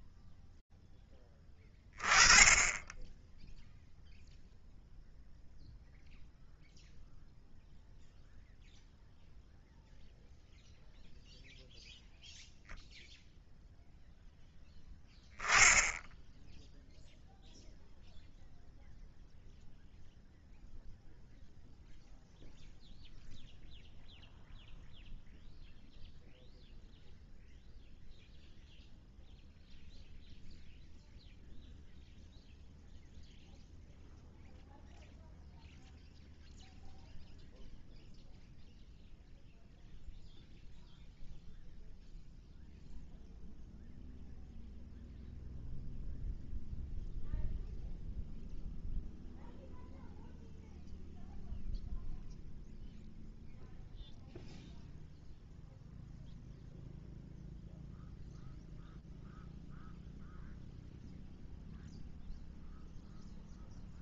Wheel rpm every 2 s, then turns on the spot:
20, 0, 0, 0, 0, 0, 10, 0, 0, 0, 0, 0, 0, 0, 0, 0, 0, 0, 0, 0, 0, 0, 0, 0, 0, 0, 0, 0, 0, 0, 0, 0.
none